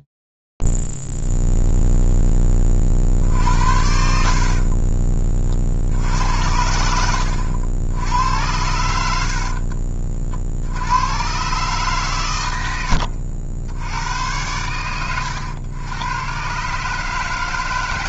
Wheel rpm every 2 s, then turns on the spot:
0, 0, 70, 70, 90, 60, 120, 100, 120.
4-6